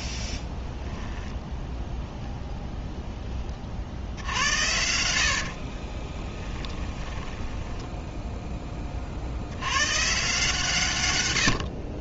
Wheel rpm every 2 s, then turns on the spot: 0, 0, 80, 10, 10, 150.
4-8